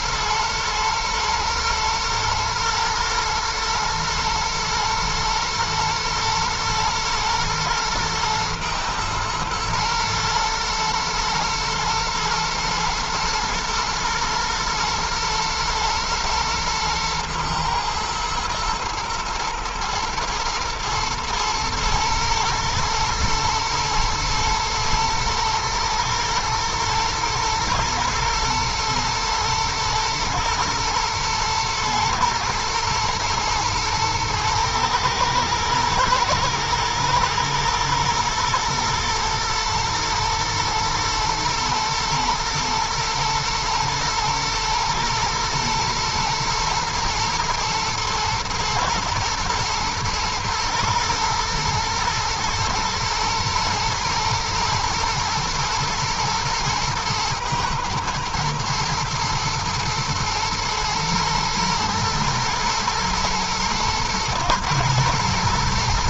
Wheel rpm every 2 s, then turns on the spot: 110, 110, 120, 120, 120, 110, 110, 120, 110, 110, 110, 110, 120, 110, 110, 120, 110, 110, 110, 120, 120, 120, 120, 120, 110, 110, 110, 120, 120, 120, 110, 110, 120.
none